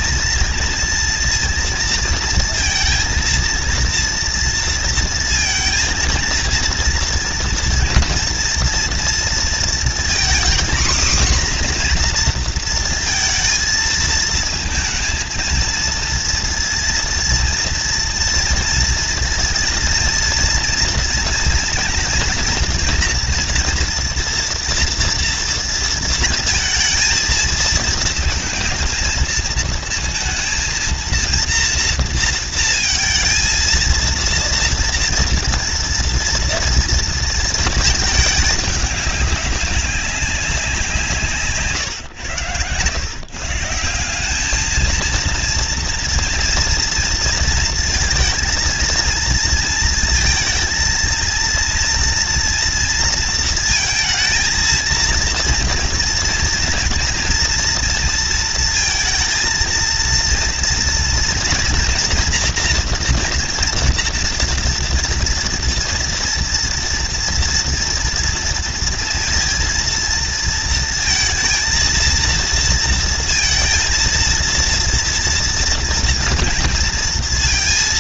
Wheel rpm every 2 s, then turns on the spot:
230, 230, 230, 230, 230, 240, 240, 220, 230, 230, 230, 240, 240, 230, 220, 230, 230, 230, 230, 220, 190, 110, 190, 230, 230, 230, 230, 230, 230, 230, 230, 230, 230, 230, 230, 230, 230, 230, 230.
none